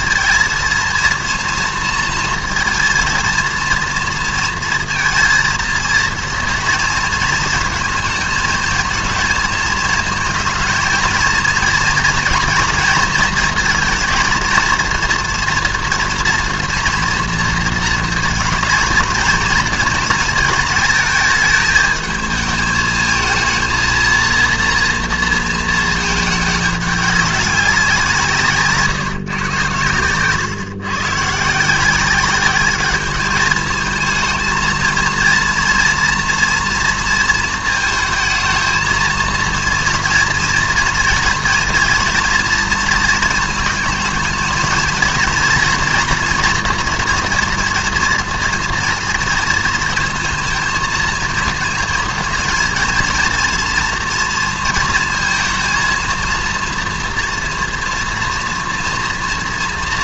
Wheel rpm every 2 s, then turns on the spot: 230, 230, 230, 230, 220, 230, 230, 230, 230, 230, 220, 220, 230, 210, 160, 130, 200, 230, 230, 230, 240, 240, 220, 230, 230, 220, 230, 230, 230, 240.
none